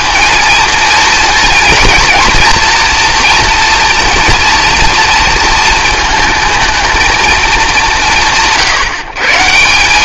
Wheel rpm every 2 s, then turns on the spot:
230, 230, 230, 230, 130.
none